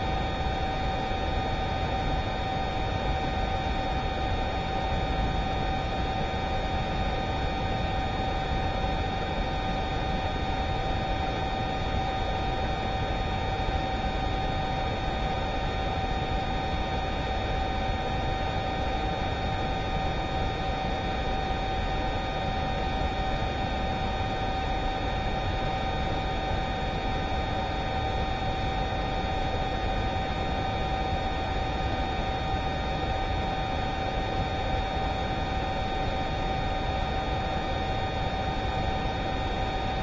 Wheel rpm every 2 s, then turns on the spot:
0, 0, 0, 0, 0, 0, 0, 0, 0, 0, 0, 0, 0, 0, 0, 0, 0, 0, 0, 0.
none